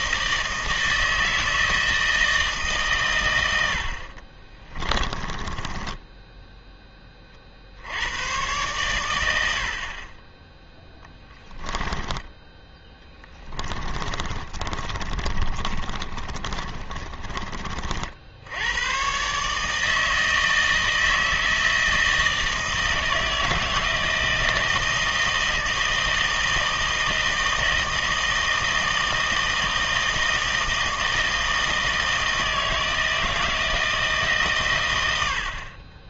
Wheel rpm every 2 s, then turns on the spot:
160, 160, 30, 10, 110, 10, 10, 40, 30, 90, 160, 160, 160, 160, 160, 160, 160, 140.
4-6 12-18